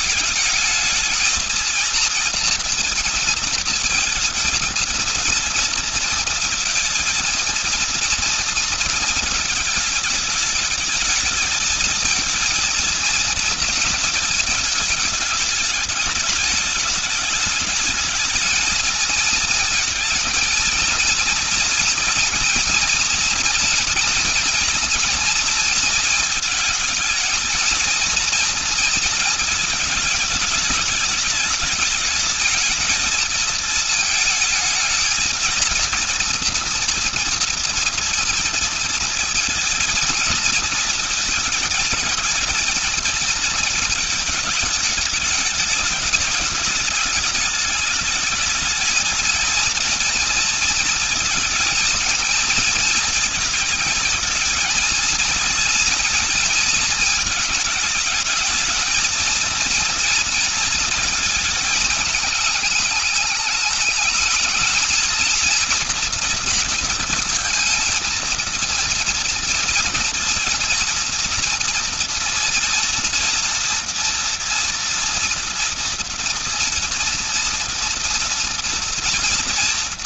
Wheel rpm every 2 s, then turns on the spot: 220, 230, 230, 230, 230, 210, 230, 220, 210, 220, 230, 230, 230, 220, 230, 220, 210, 220, 230, 230, 230, 220, 210, 210, 220, 230, 230, 230, 230, 220, 230, 210, 220, 230, 230, 230, 230, 240, 240, 230.
none